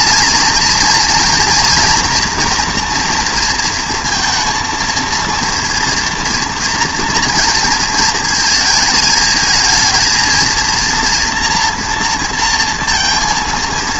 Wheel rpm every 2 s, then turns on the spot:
230, 240, 230, 230, 230, 230, 230.
none